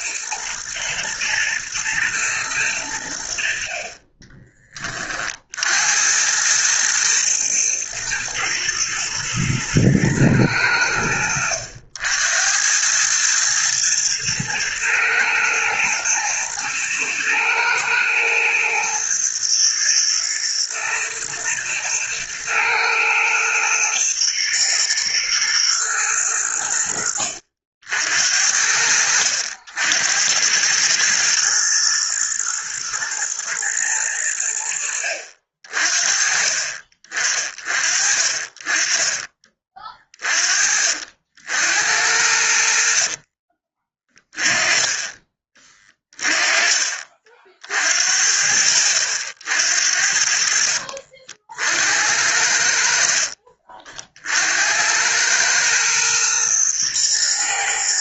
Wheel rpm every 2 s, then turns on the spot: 110, 110, 30, 110, 110, 100, 90, 110, 120, 120, 120, 110, 120, 90, 60, 100, 110, 80, 40, 30, 40, 70, 20, 30, 60, 60, 70, 80, 120.
42-44